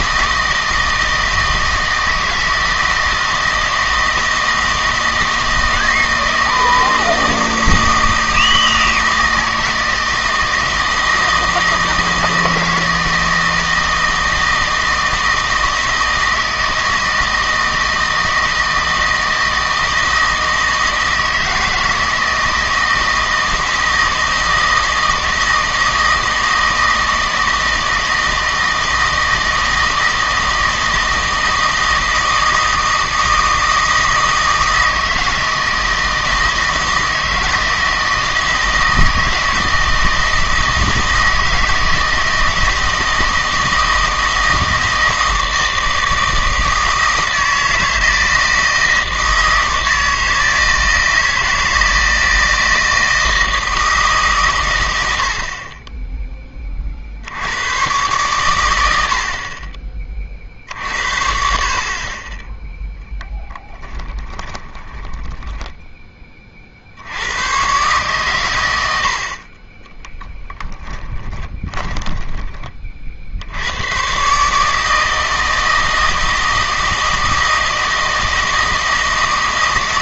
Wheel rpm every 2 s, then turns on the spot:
160, 160, 160, 160, 160, 160, 160, 160, 160, 160, 160, 160, 160, 160, 160, 160, 160, 160, 160, 160, 160, 160, 160, 160, 160, 160, 160, 110, 30, 100, 60, 0, 10, 50, 90, 10, 40, 160, 160, 160.
64-66 70-72